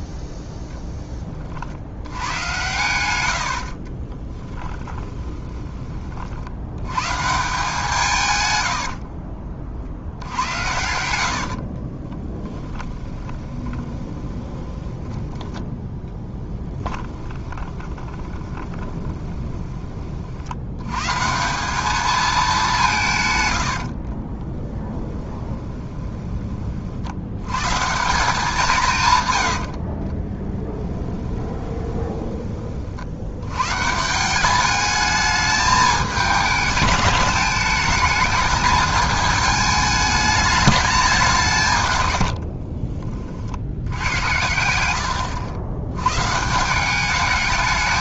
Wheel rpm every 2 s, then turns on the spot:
0, 100, 20, 80, 100, 70, 20, 20, 10, 20, 90, 190, 10, 40, 180, 10, 40, 200, 210, 220, 200, 40, 80, 180.
4-6 8-20 24-26 30-32 42-44